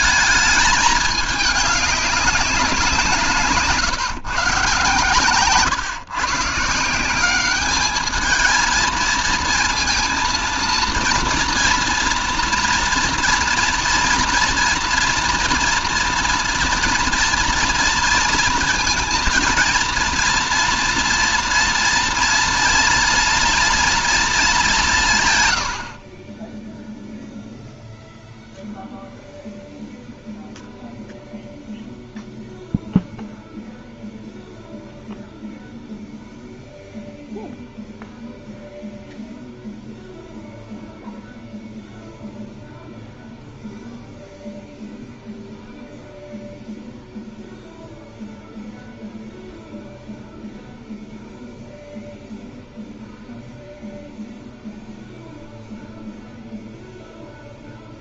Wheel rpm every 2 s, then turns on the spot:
220, 190, 130, 150, 220, 230, 230, 230, 230, 230, 230, 240, 220, 20, 0, 0, 0, 0, 0, 0, 0, 0, 0, 0, 0, 0, 0, 0, 0.
none